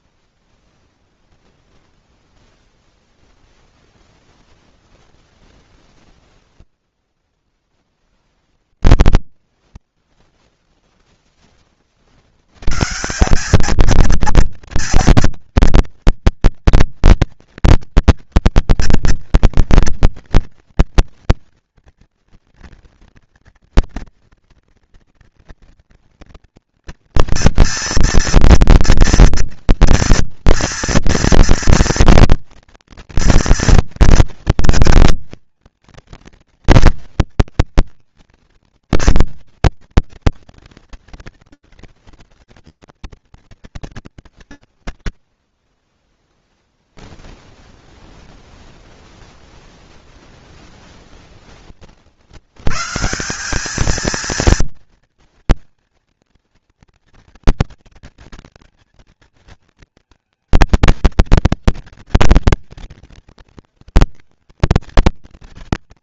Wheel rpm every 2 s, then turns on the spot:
0, 0, 0, 10, 10, 20, 200, 240, 230, 230, 240, 230, 230, 230, 240, 240, 230, 230, 230, 230, 180, 200, 20, 0, 0, 50, 200, 230, 230, 230, 220, 190, 180.
6-10